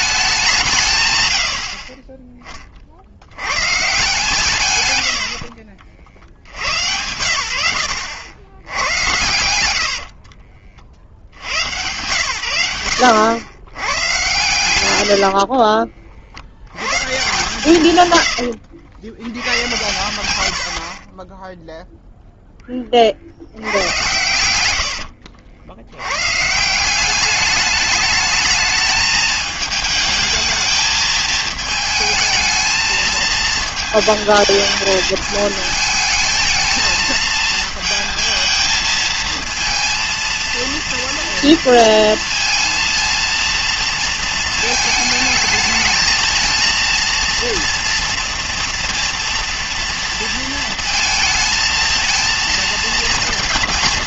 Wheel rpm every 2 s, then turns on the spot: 180, 30, 130, 70, 80, 50, 80, 120, 90, 90, 80, 10, 90, 150, 220, 220, 220, 220, 220, 220, 230, 230, 220, 220, 230, 230, 230.
14-16 18-20 24-26